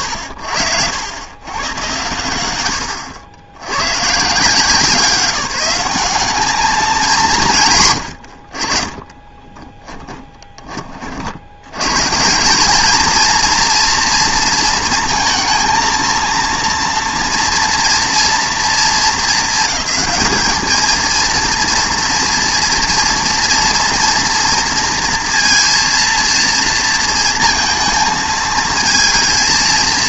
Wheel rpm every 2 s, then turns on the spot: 100, 80, 150, 200, 70, 30, 200, 230, 230, 230, 220, 230, 230, 230, 220.
none